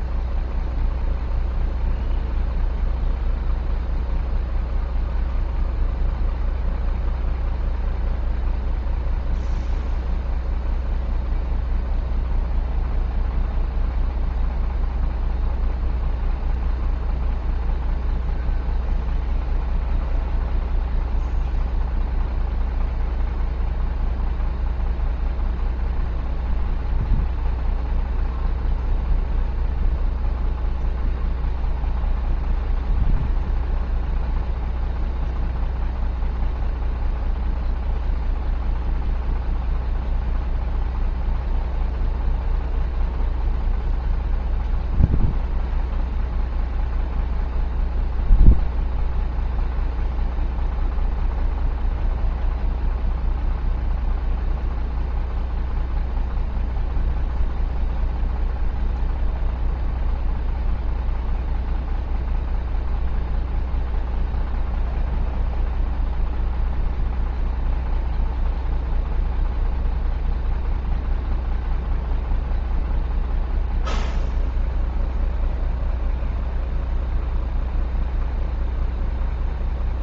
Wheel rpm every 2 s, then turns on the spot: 0, 0, 0, 0, 0, 0, 0, 0, 0, 0, 0, 0, 0, 0, 0, 0, 0, 0, 0, 0, 0, 0, 0, 0, 0, 0, 0, 0, 0, 0, 0, 0, 0, 0, 0, 0, 0, 0, 0, 0.
none